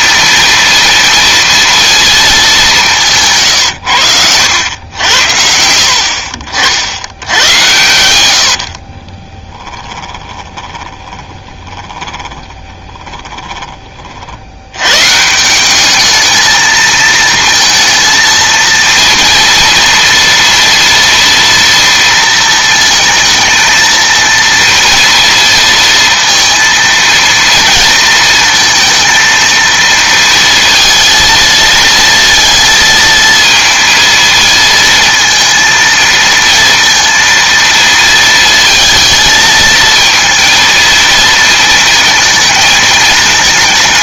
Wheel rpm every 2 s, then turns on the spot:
230, 200, 100, 60, 80, 20, 20, 90, 220, 230, 230, 230, 220, 230, 230, 230, 230, 230, 230, 220, 230, 220.
4-6 8-14